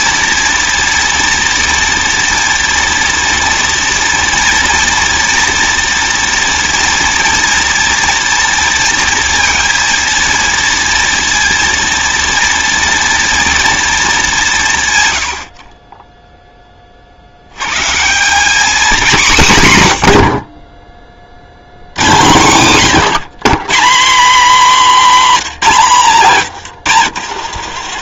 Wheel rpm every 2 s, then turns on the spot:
230, 230, 230, 230, 230, 230, 230, 160, 10, 210, 40, 140, 260, 160.
none